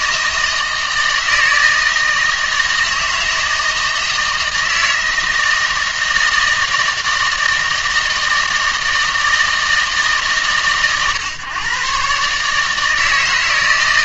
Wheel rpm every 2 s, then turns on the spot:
160, 160, 160, 160, 160, 130, 150.
none